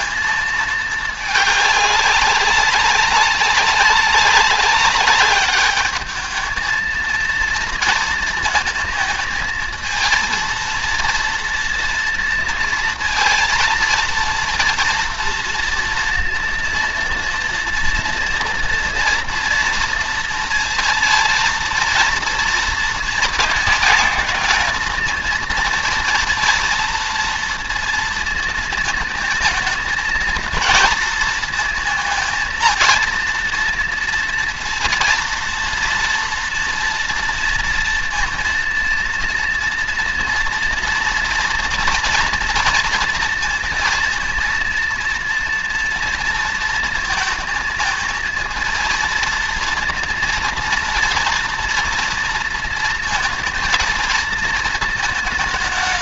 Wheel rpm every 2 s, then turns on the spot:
220, 200, 200, 220, 230, 230, 230, 230, 230, 230, 230, 230, 230, 230, 220, 230, 230, 230, 230, 230, 240, 240, 230, 230, 220, 230, 230, 230.
none